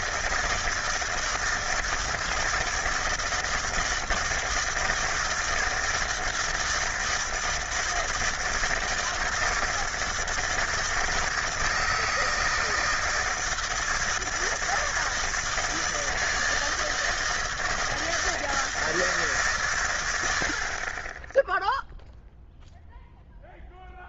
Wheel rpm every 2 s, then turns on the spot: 160, 160, 160, 160, 160, 160, 160, 160, 160, 160, 50, 0.
none